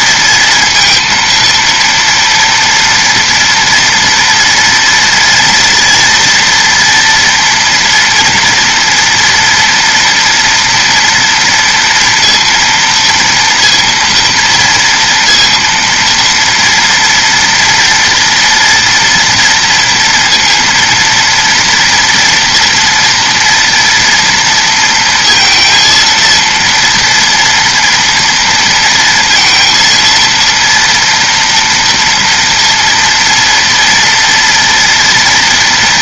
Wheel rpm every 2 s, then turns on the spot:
230, 230, 230, 230, 240, 230, 230, 230, 230, 230, 230, 230, 230, 230, 230, 230, 230, 230.
none